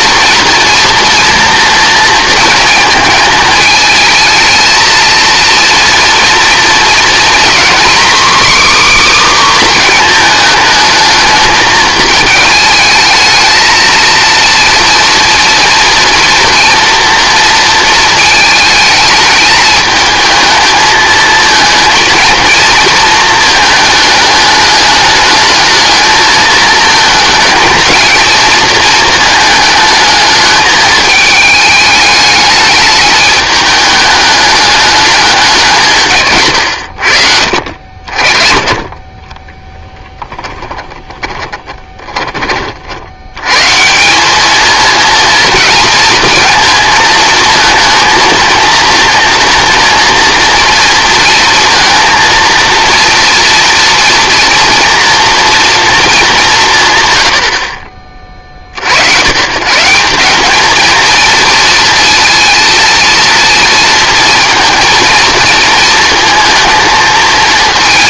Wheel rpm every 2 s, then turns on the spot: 230, 220, 220, 230, 280, 220, 220, 230, 230, 220, 220, 230, 210, 230, 230, 220, 210, 210, 120, 30, 10, 40, 220, 230, 230, 230, 230, 230, 190, 50, 210, 230, 220, 230.
36-38 40-42